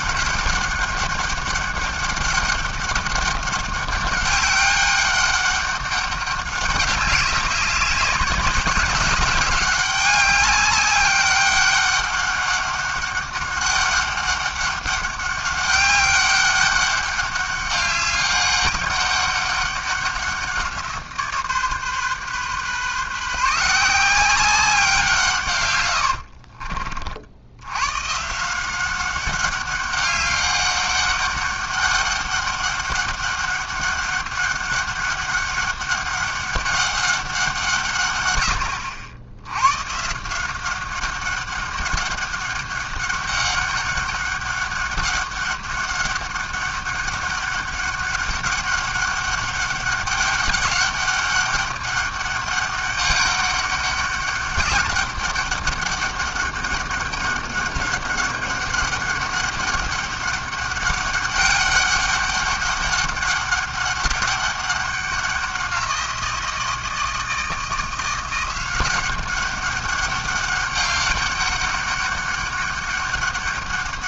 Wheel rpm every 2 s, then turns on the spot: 200, 200, 200, 200, 190, 200, 200, 200, 200, 200, 180, 140, 190, 50, 170, 200, 200, 200, 200, 100, 180, 200, 200, 200, 200, 200, 200, 200, 200, 200, 200, 200, 200, 170, 180, 200, 200.
26-28